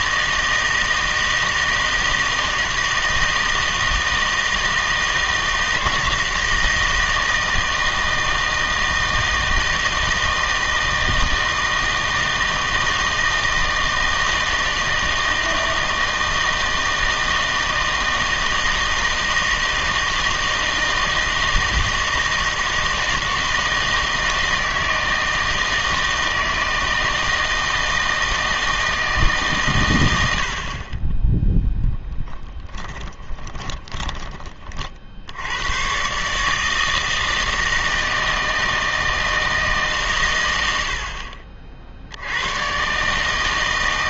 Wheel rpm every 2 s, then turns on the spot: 160, 160, 160, 160, 160, 160, 160, 160, 160, 160, 160, 160, 160, 160, 160, 40, 20, 40, 160, 160, 70, 130.
32-34